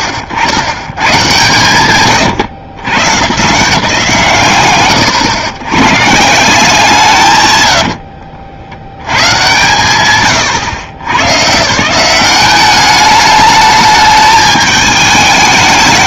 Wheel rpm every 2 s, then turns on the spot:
100, 130, 150, 170, 90, 110, 200, 210.
none